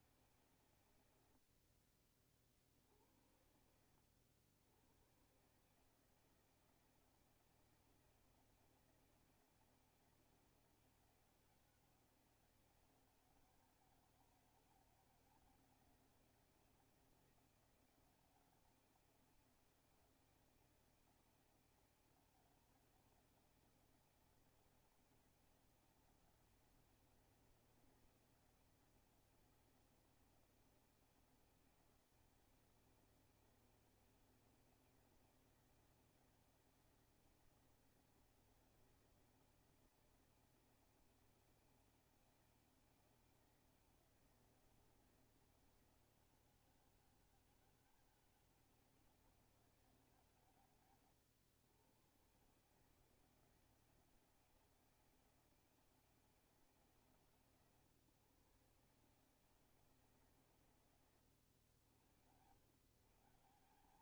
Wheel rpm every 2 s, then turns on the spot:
140, 50, 100, 160, 160, 160, 160, 160, 170, 160, 160, 160, 160, 160, 160, 160, 160, 160, 160, 160, 160, 160, 160, 160, 160, 150, 130, 160, 160, 140, 140, 110.
none